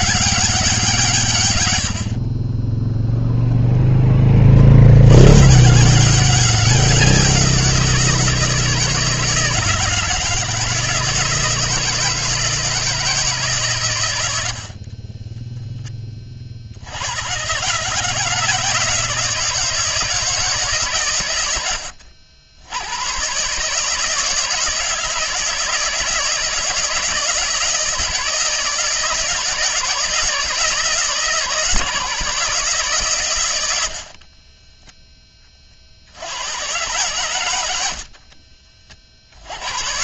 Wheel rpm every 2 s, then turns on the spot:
170, 10, 90, 180, 160, 160, 160, 30, 80, 160, 130, 110, 160, 160, 160, 160, 140, 10, 120, 50.
14-16